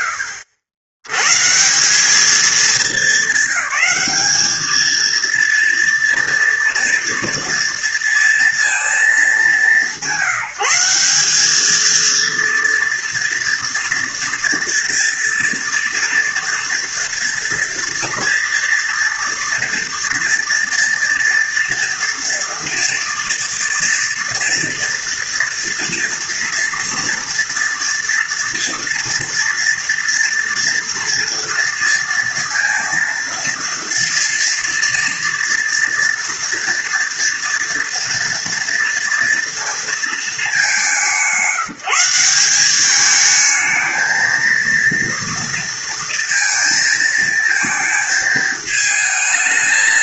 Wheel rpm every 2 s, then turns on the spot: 90, 200, 230, 230, 210, 190, 230, 230, 230, 240, 230, 230, 240, 230, 230, 230, 230, 230, 230, 230, 180, 210, 230, 230, 210.
none